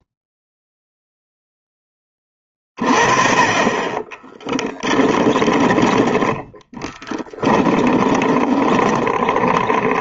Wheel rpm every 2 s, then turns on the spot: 0, 40, 10, 10, 20.
6-10